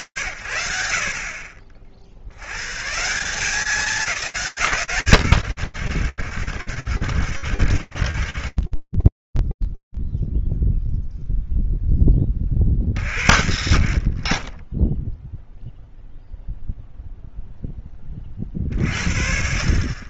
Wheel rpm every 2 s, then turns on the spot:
50, 200, 110, 70, 20, 0, 60, 0, 10, 40.
4-10